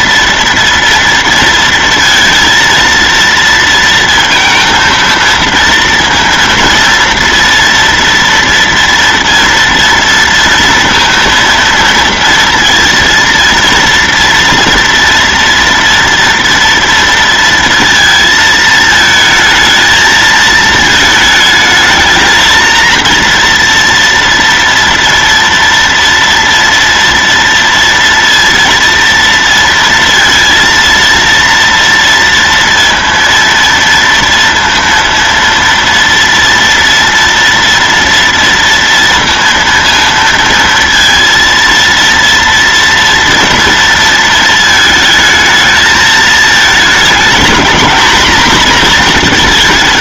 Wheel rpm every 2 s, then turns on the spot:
230, 230, 230, 230, 230, 230, 230, 240, 230, 220, 220, 230, 230, 230, 230, 230, 230, 230, 230, 230, 230, 230, 220, 220, 230.
none